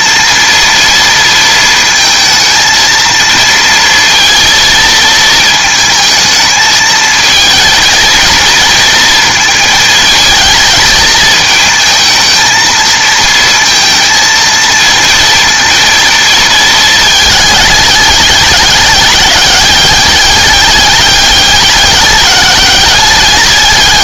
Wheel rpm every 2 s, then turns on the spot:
230, 230, 230, 220, 230, 220, 220, 230, 220, 200, 200, 200.
none